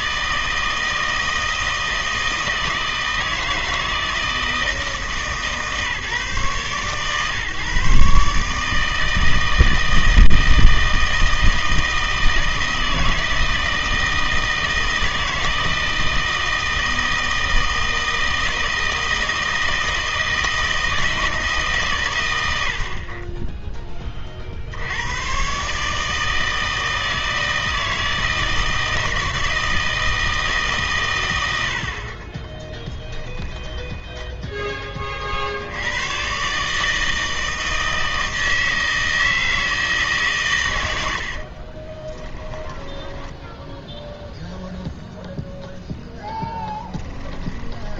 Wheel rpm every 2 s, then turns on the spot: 160, 160, 160, 130, 150, 160, 160, 160, 160, 160, 160, 100, 70, 160, 160, 150, 20, 10, 150, 160, 120, 20, 0, 10.
32-34 42-44 46-48